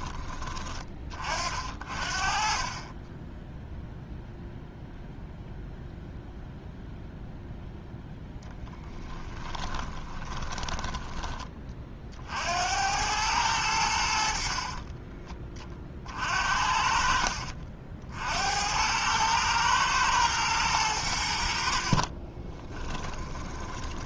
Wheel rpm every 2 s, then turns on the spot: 30, 20, 0, 0, 10, 20, 90, 30, 50, 90, 100, 20.
8-10 14-16 22-24